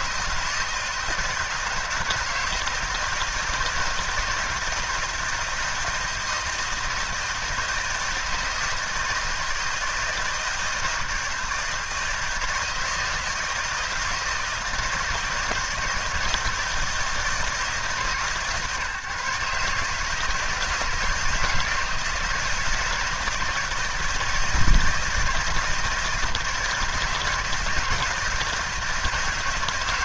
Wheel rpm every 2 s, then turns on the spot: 160, 160, 160, 160, 160, 160, 160, 160, 160, 140, 160, 160, 160, 160, 170.
none